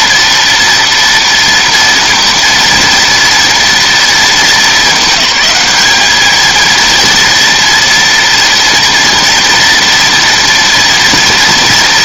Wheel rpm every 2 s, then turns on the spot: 230, 230, 200, 230, 230, 230.
none